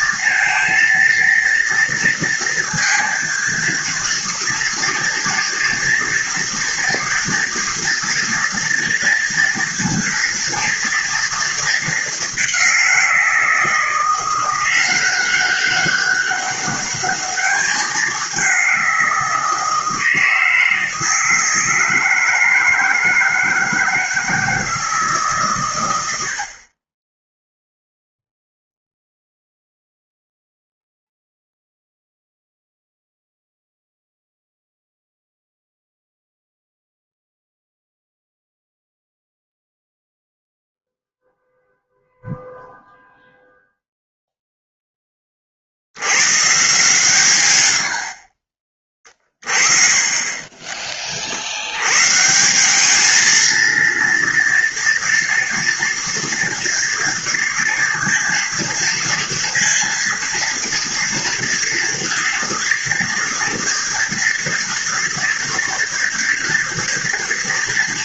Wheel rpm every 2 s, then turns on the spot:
230, 230, 230, 230, 230, 230, 190, 180, 200, 190, 160, 160, 160, 40, 0, 0, 0, 0, 0, 0, 0, 0, 0, 140, 40, 20, 180, 230, 230, 230, 230, 230, 230, 230.
50-52